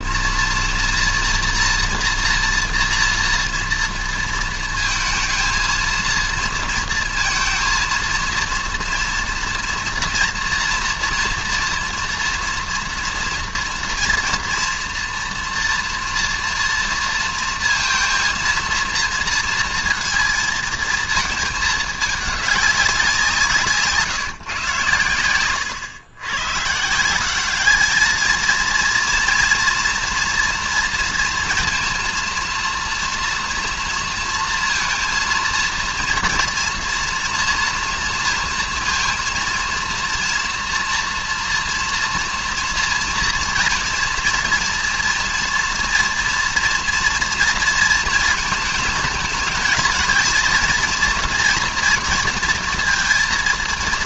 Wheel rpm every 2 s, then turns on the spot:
240, 230, 230, 230, 230, 230, 230, 230, 230, 230, 230, 200, 120, 150, 230, 230, 230, 230, 230, 230, 240, 230, 230, 230, 220, 230, 230.
none